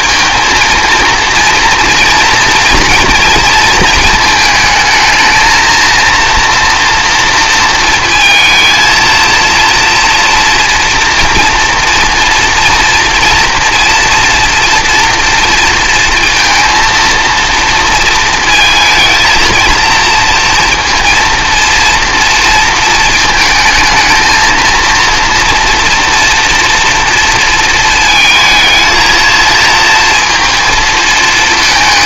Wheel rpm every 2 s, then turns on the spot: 230, 230, 220, 230, 230, 240, 230, 240, 230, 220, 230, 230, 220, 240, 220, 230.
none